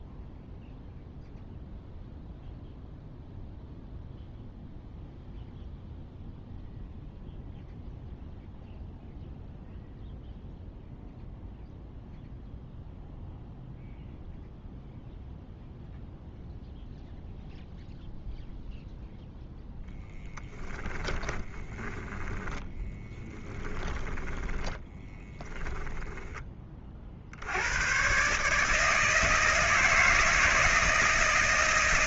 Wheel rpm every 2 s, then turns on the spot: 0, 0, 0, 0, 0, 0, 0, 0, 0, 0, 10, 10, 10, 30, 150, 160.
20-26